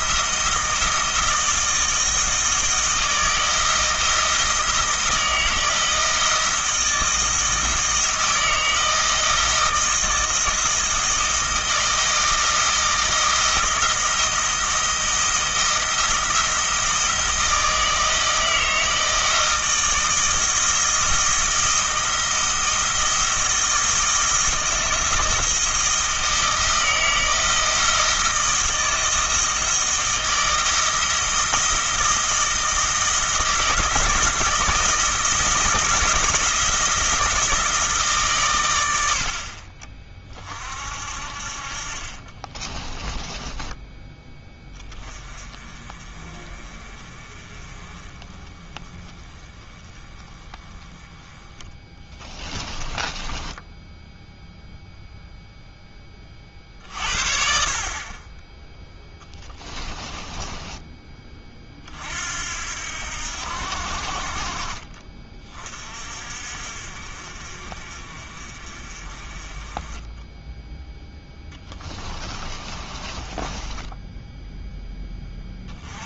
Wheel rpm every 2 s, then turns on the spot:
160, 160, 160, 160, 160, 160, 160, 160, 160, 160, 160, 170, 170, 160, 160, 160, 160, 160, 170, 100, 50, 30, 20, 30, 20, 10, 20, 0, 40, 10, 10, 70, 40, 50, 40, 0, 30, 10.
42-44 52-54 60-62 72-74